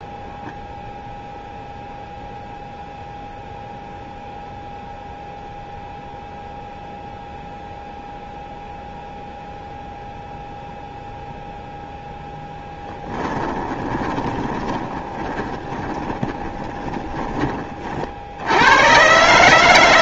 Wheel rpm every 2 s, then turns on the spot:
0, 0, 0, 0, 0, 0, 10, 20, 20, 100.
12-18